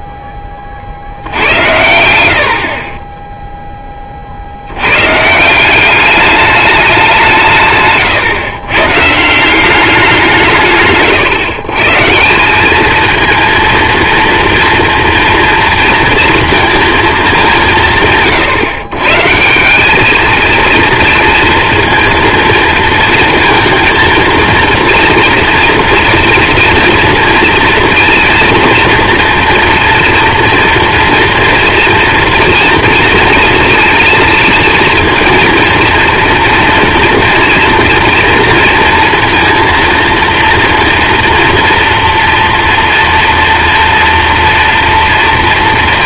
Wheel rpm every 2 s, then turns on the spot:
70, 10, 150, 180, 170, 130, 230, 230, 200, 150, 230, 230, 230, 230, 240, 230, 230, 230, 230, 230, 230, 230, 230.
none